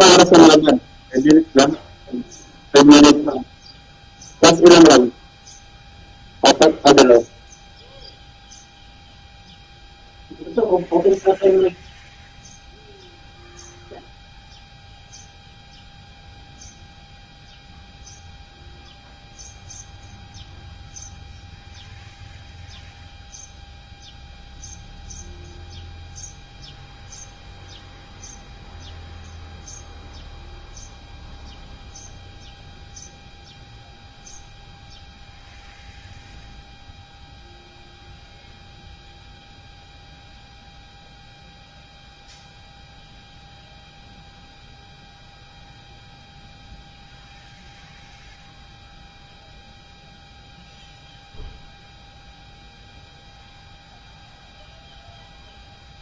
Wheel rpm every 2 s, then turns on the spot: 0, 0, 0, 0, 0, 0, 0, 0, 0, 0, 0, 0, 0, 0, 0, 0, 0, 0, 0, 0, 0, 0, 0, 0, 0, 0, 0, 0.
none